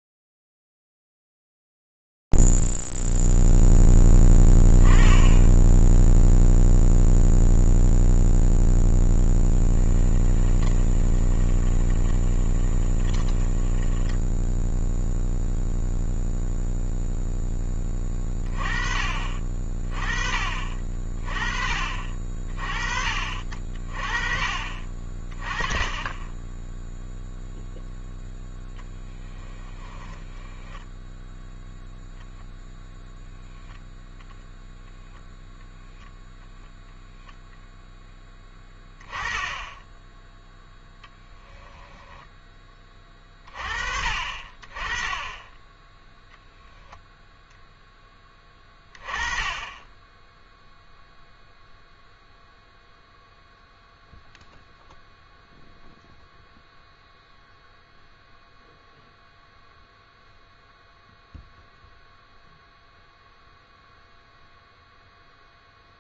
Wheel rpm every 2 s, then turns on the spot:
0, 0, 0, 0, 0, 10, 20, 10, 0, 30, 30, 40, 40, 10, 0, 10, 0, 0, 0, 10, 0, 20, 40, 0, 20, 0, 0, 0, 0, 0, 0, 0, 0.
10-16